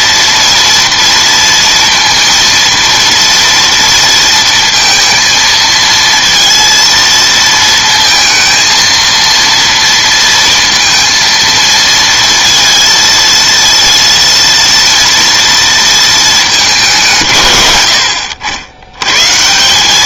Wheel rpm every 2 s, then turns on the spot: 230, 230, 230, 230, 230, 230, 230, 230, 160, 120.
none